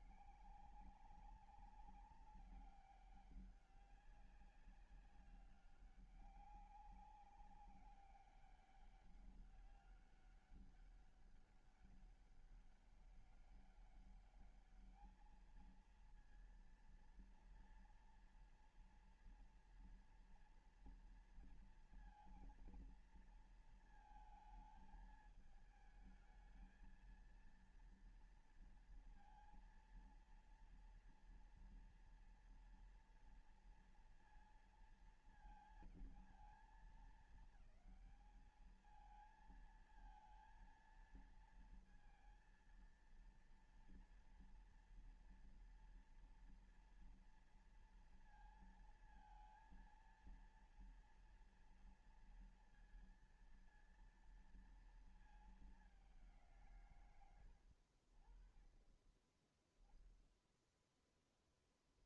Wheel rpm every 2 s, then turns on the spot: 140, 190, 190, 200, 200, 200, 200, 200, 230, 240, 230, 230, 220, 220, 230, 230, 230, 230, 220, 210, 230, 230, 230, 230, 230, 230, 230, 230, 190, 50, 10.
none